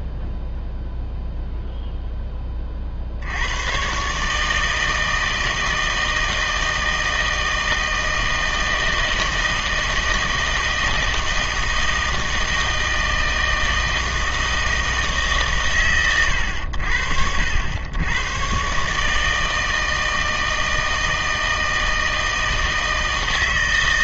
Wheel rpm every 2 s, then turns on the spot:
0, 40, 160, 160, 160, 160, 160, 160, 80, 130, 160, 160.
none